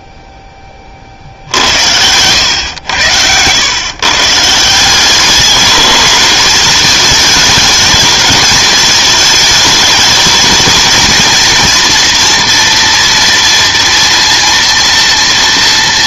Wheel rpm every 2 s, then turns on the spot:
70, 110, 210, 210, 220, 230, 230, 230.
none